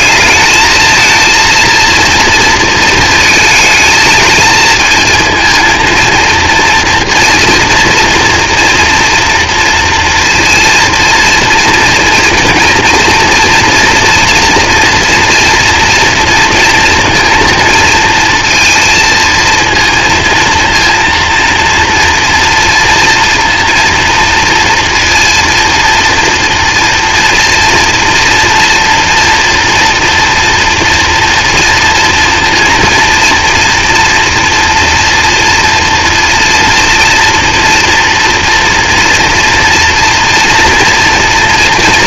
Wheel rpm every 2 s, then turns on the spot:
220, 230, 230, 240, 230, 230, 230, 230, 230, 230, 230, 230, 230, 230, 240, 230, 230, 230, 230, 240, 240.
none